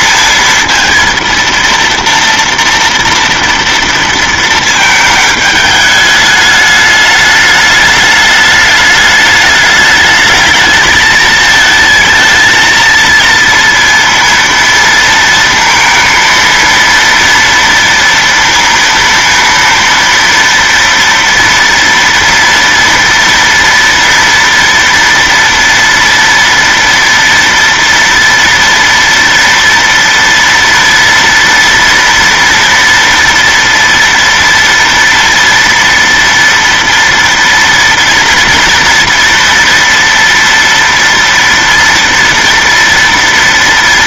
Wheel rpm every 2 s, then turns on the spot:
230, 230, 220, 210, 210, 210, 230, 230, 230, 230, 230, 230, 230, 230, 230, 230, 230, 230, 230, 230, 230, 230.
none